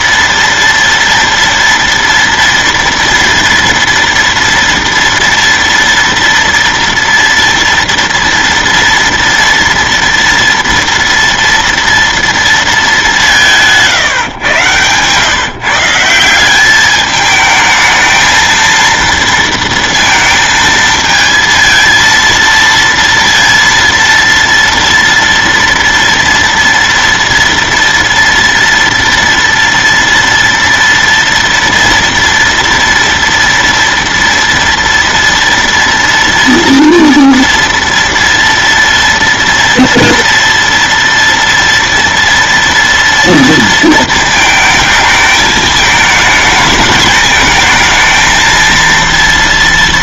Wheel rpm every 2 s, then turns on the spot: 230, 230, 230, 230, 230, 230, 210, 120, 200, 230, 220, 230, 230, 230, 230, 230, 230, 230, 230, 230, 240, 230, 220, 220, 230.
14-16